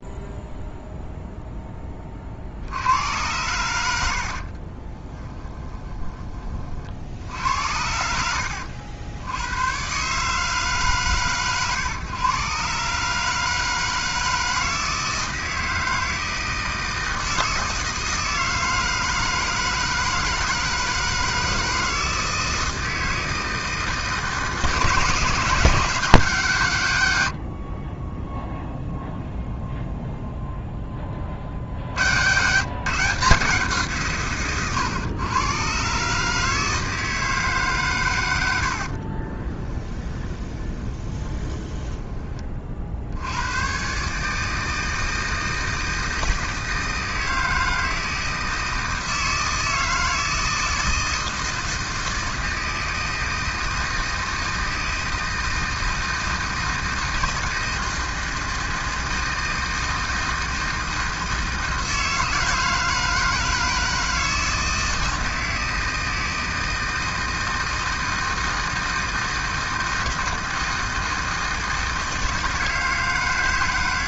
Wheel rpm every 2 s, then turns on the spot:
0, 50, 60, 30, 80, 140, 130, 160, 160, 160, 160, 160, 150, 160, 0, 0, 130, 130, 150, 100, 20, 30, 150, 160, 160, 160, 160, 160, 160, 160, 160, 160, 160, 160, 160, 160, 160.
4-6 40-42